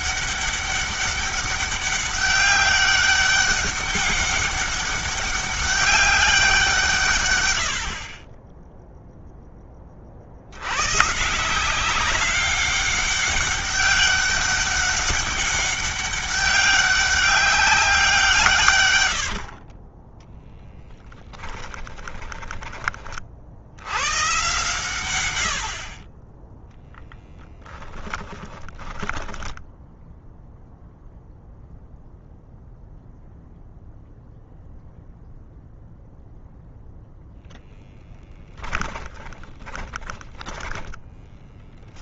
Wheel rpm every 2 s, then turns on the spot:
200, 200, 200, 180, 10, 120, 200, 200, 200, 130, 10, 20, 120, 0, 10, 0, 0, 0, 0, 10, 10.
28-30 38-42